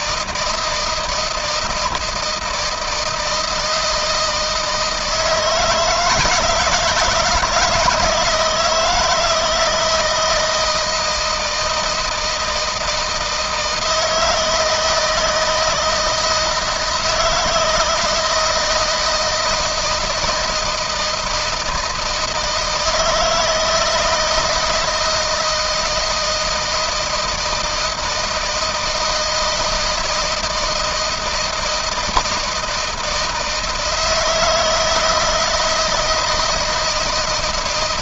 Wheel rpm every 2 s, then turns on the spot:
160, 160, 160, 160, 160, 160, 160, 160, 160, 160, 160, 160, 160, 160, 160, 160, 160, 160, 170.
none